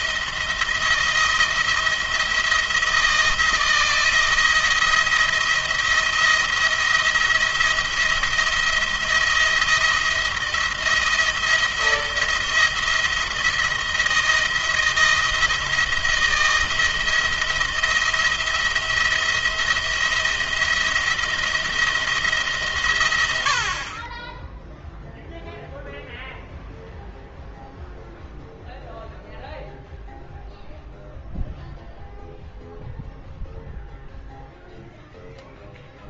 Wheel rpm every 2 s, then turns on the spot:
170, 160, 160, 170, 170, 170, 170, 170, 170, 170, 170, 140, 10, 0, 0, 0, 0, 0.
none